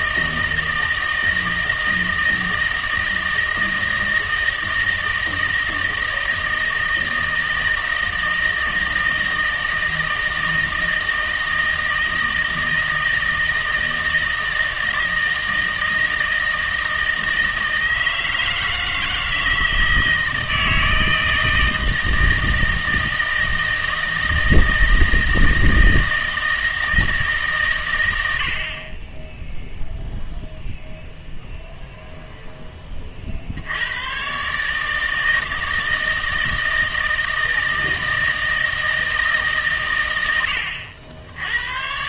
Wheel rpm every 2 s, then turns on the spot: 160, 160, 160, 160, 160, 160, 160, 160, 160, 160, 160, 160, 160, 160, 40, 0, 10, 150, 160, 160, 80.
none